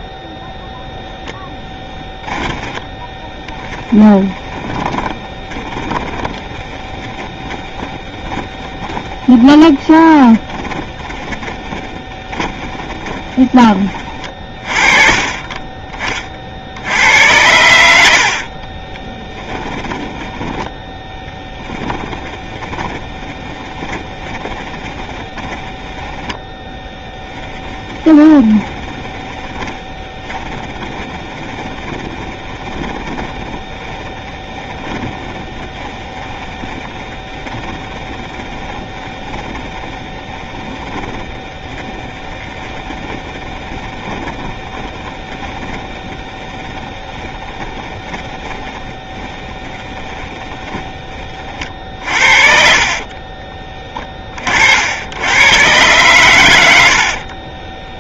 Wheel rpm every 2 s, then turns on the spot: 0, 20, 20, 20, 20, 20, 20, 30, 60, 40, 10, 10, 20, 10, 20, 20, 30, 20, 20, 20, 10, 10, 30, 10, 20, 20, 40, 70, 90.
2-14 18-54